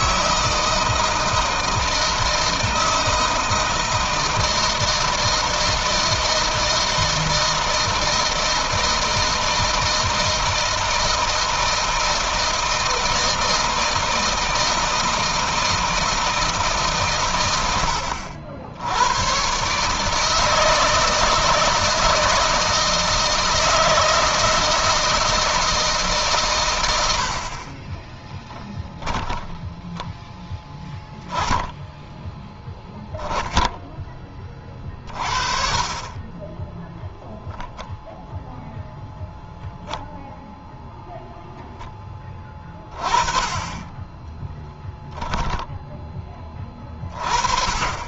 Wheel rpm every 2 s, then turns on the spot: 160, 160, 160, 160, 160, 160, 160, 160, 140, 100, 160, 160, 160, 100, 10, 20, 10, 30, 0, 0, 0, 20, 10, 30.
28-30 44-46